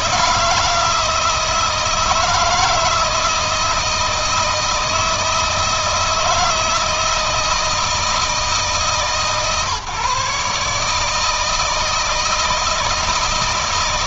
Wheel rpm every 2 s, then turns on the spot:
160, 160, 160, 160, 140, 150, 160.
none